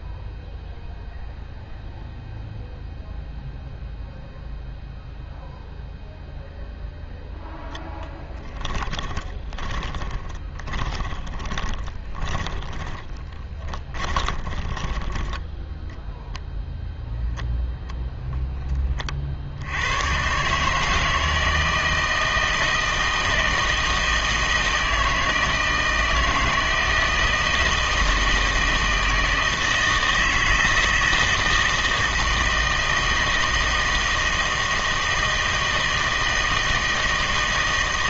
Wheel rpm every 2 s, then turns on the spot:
0, 0, 0, 0, 10, 20, 20, 20, 0, 10, 150, 160, 160, 160, 160, 160, 160, 160, 160.
8-16